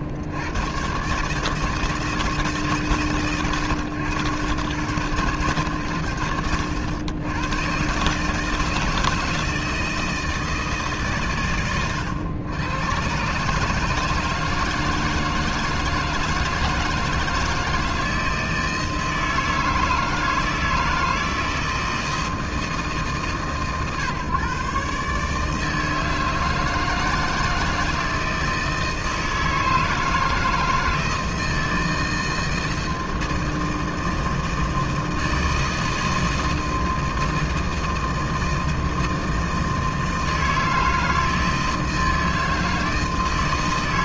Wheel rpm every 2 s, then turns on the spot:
50, 150, 100, 80, 160, 160, 110, 160, 160, 160, 160, 160, 140, 160, 160, 160, 160, 160, 160, 160, 160, 160.
none